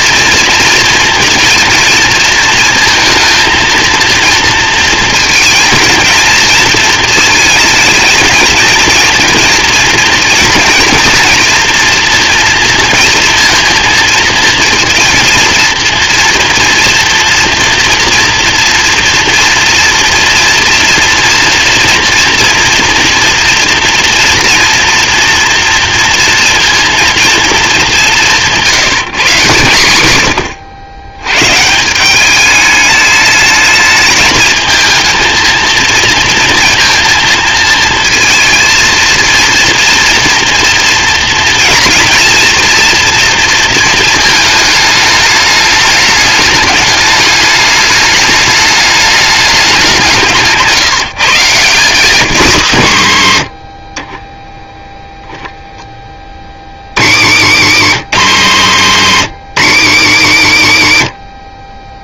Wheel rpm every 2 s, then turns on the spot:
230, 230, 230, 220, 230, 230, 230, 230, 240, 240, 240, 230, 240, 230, 170, 90, 210, 220, 230, 230, 230, 230, 220, 210, 210, 160, 120, 0, 60, 120, 110.
none